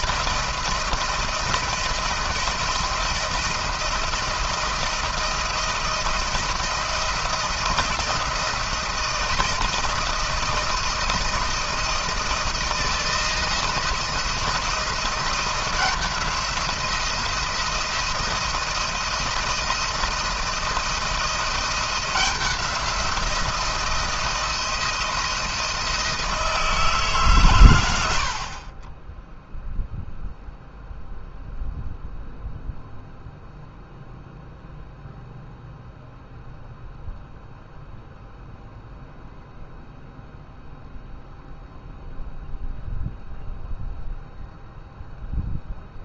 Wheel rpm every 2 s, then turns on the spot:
170, 170, 170, 160, 170, 170, 160, 170, 170, 170, 170, 180, 170, 160, 30, 0, 0, 0, 0, 0, 0, 0, 0.
none